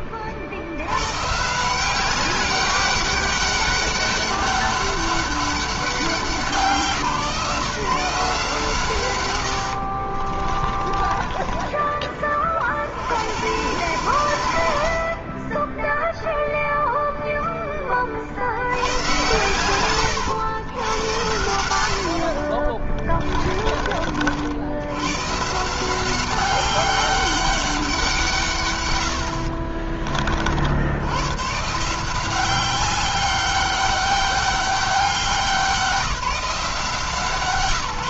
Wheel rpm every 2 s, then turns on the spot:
100, 200, 200, 160, 140, 30, 60, 60, 0, 90, 100, 20, 90, 190, 140, 60, 190, 190, 160.
10-12 22-24